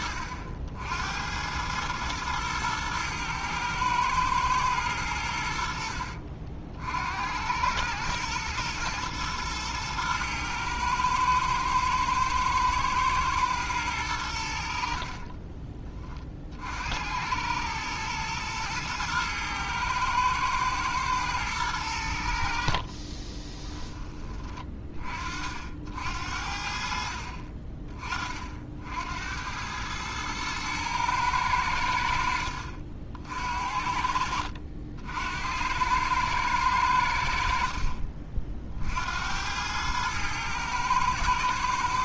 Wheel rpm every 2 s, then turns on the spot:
70, 110, 100, 70, 120, 110, 110, 60, 70, 110, 110, 50, 30, 60, 70, 110, 60, 70, 90, 60, 110.
22-24